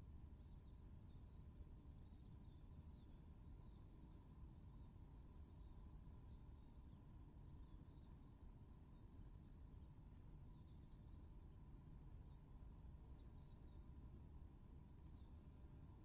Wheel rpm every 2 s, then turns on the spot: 0, 0, 0, 0, 0, 0, 0, 0.
none